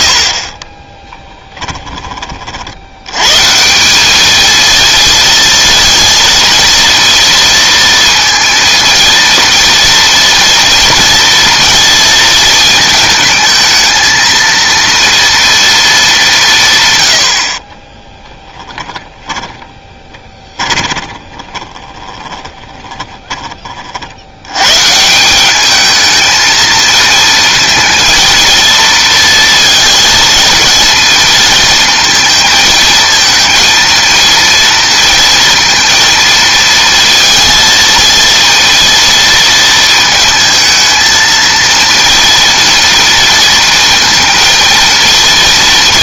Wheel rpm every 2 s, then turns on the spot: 30, 70, 220, 230, 230, 240, 220, 230, 140, 10, 30, 20, 120, 220, 230, 230, 220, 230, 230, 230, 220, 230, 230.
0-2 18-24